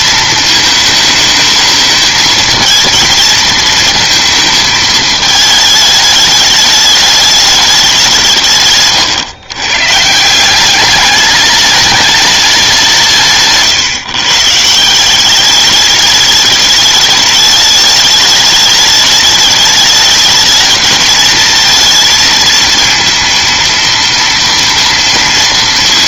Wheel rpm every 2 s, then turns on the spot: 220, 220, 220, 210, 140, 190, 190, 150, 210, 210, 220, 230, 230.
none